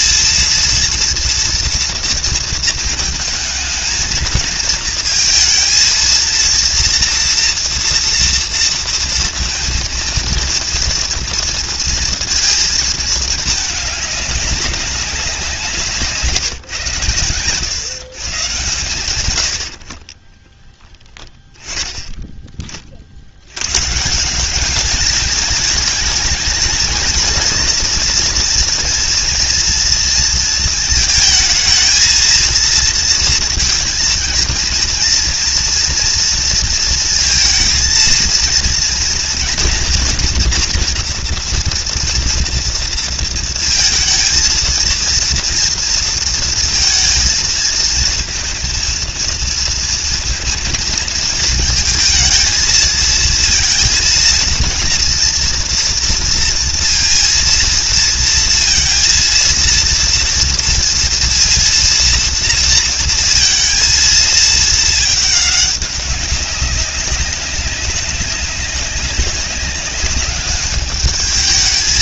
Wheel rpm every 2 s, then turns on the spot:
230, 220, 220, 230, 230, 230, 220, 190, 120, 110, 10, 50, 220, 230, 240, 220, 230, 240, 230, 230, 230, 230, 230, 230, 230, 220, 220, 230, 230, 230, 230, 230, 220, 200, 200, 210.
none